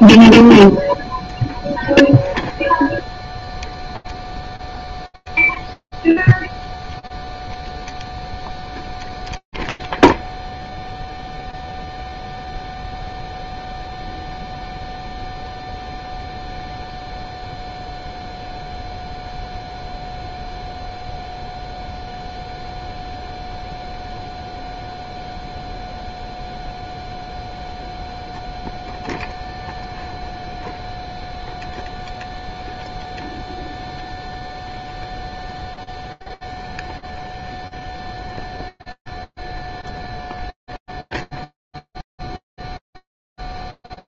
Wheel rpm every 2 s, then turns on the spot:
0, 0, 0, 0, 0, 0, 0, 0, 0, 0, 0, 0, 0, 0, 0, 0, 0, 0, 0, 0, 0, 0.
none